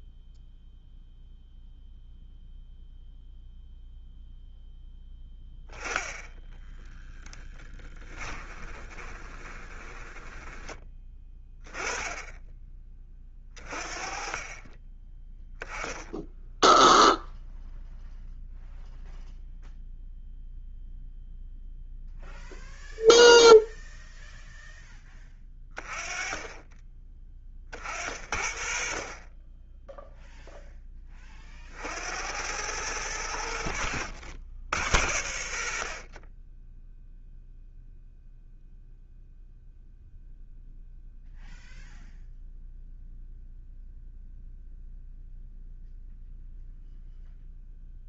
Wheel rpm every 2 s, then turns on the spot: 0, 0, 0, 10, 20, 10, 20, 20, 0, 0, 0, 0, 10, 20, 40, 20, 100, 80, 0, 0, 0, 0, 0, 0.
6-10